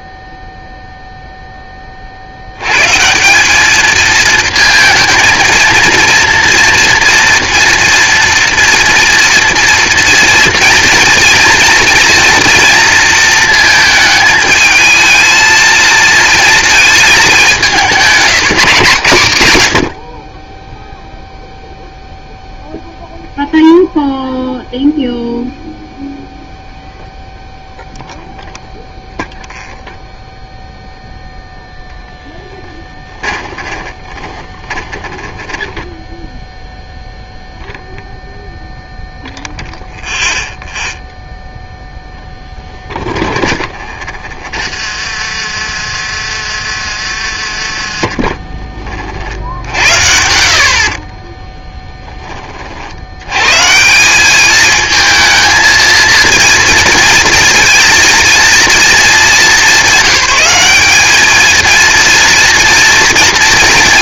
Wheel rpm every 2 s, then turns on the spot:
0, 90, 220, 230, 240, 230, 230, 220, 220, 190, 10, 0, 0, 0, 0, 0, 10, 30, 0, 0, 0, 10, 40, 60, 20, 60, 40, 210, 230, 230, 200, 240.
32-36 42-50